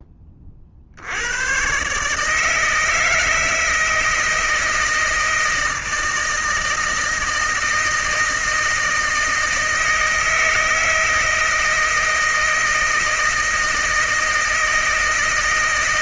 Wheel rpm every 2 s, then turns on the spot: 40, 150, 160, 160, 160, 160, 160, 160.
none